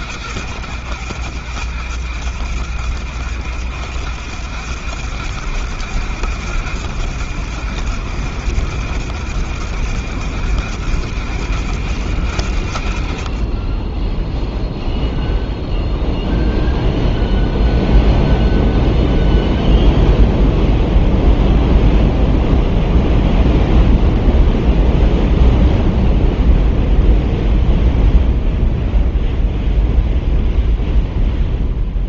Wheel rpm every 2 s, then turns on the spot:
80, 80, 90, 90, 90, 90, 70, 0, 0, 0, 0, 0, 0, 0, 0, 0.
none